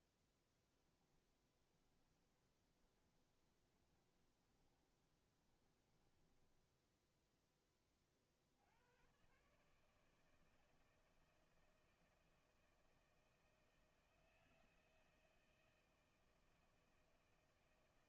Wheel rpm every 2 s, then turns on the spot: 10, 20, 20, 20, 70, 160, 160, 160, 160.
0-8